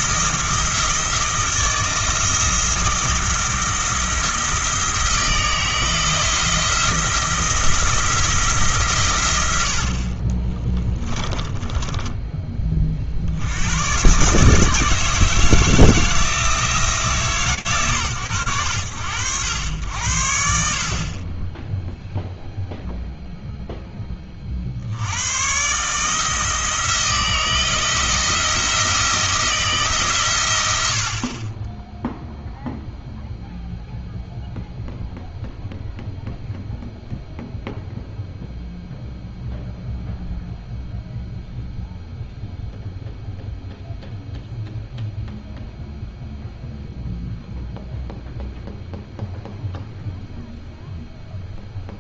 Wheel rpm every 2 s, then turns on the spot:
170, 170, 170, 170, 140, 20, 40, 150, 160, 80, 40, 0, 80, 160, 160, 80, 0, 0, 0, 0, 0, 0, 0, 0, 0, 0.
10-12